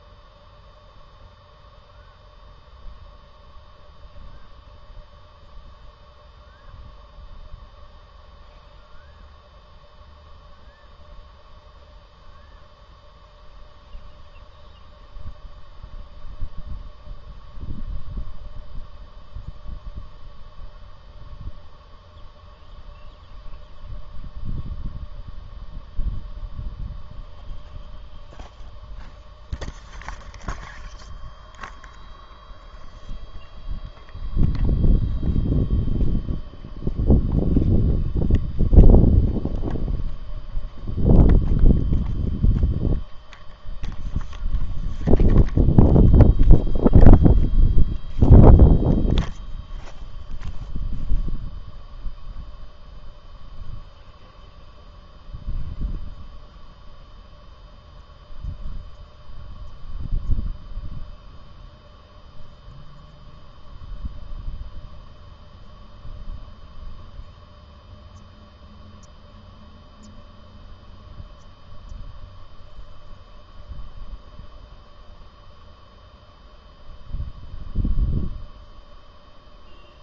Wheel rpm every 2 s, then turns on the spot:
0, 0, 0, 0, 0, 0, 0, 0, 0, 0, 0, 0, 0, 0, 0, 0, 0, 0, 0, 0, 0, 0, 0, 0, 0, 0, 0, 0, 0, 0, 0, 0, 0, 0, 0, 0, 0, 0, 0, 0.
none